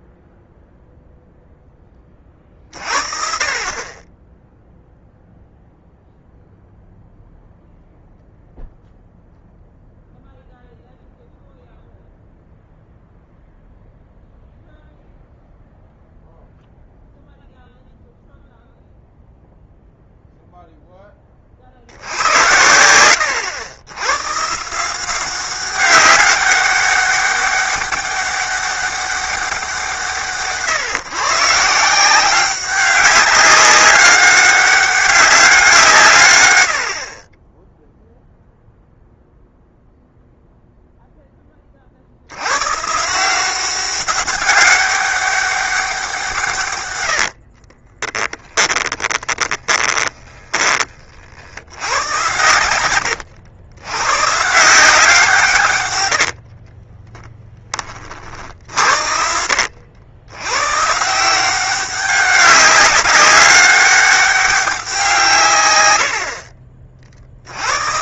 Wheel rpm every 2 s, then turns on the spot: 0, 50, 0, 0, 0, 0, 0, 0, 0, 0, 10, 90, 170, 200, 200, 140, 190, 200, 70, 0, 0, 130, 200, 110, 20, 30, 110, 170, 30, 60, 130, 200, 180, 50.
46-50 56-58